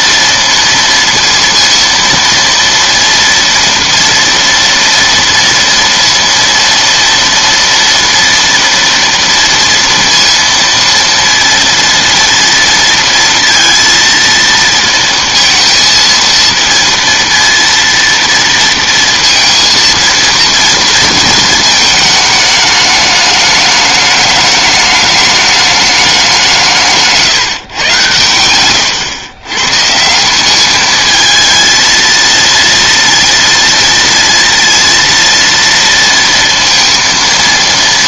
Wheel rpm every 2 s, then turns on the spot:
230, 230, 230, 230, 230, 230, 230, 230, 230, 230, 230, 210, 210, 170, 110, 200, 230, 230, 230.
none